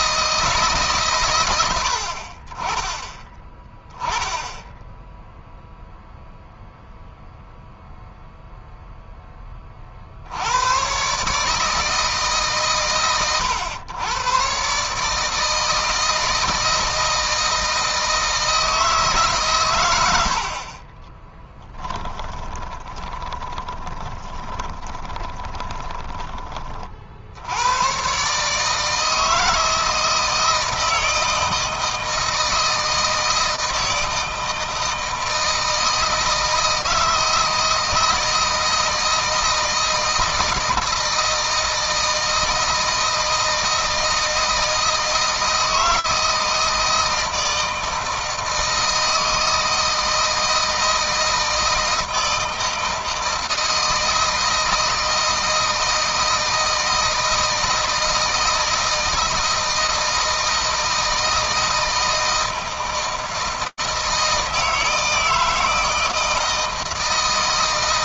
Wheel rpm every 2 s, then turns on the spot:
130, 10, 0, 0, 0, 120, 130, 140, 160, 150, 20, 20, 20, 50, 160, 160, 160, 160, 160, 160, 160, 160, 160, 160, 160, 160, 160, 160, 160, 160, 160, 160, 160, 160.
20-26